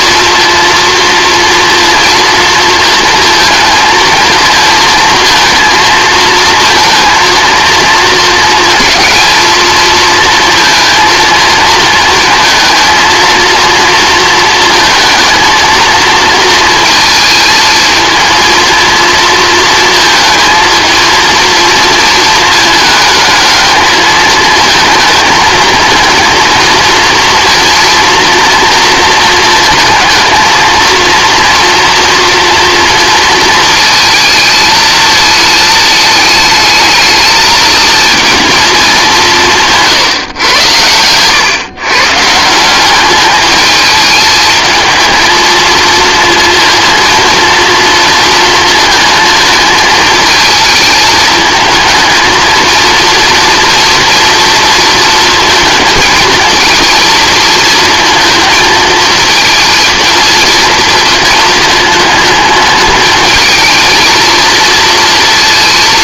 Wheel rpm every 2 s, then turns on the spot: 230, 230, 220, 230, 220, 220, 230, 220, 230, 230, 230, 220, 220, 230, 230, 230, 230, 220, 210, 220, 110, 180, 220, 230, 220, 220, 220, 230, 220, 220, 230, 210, 230.
none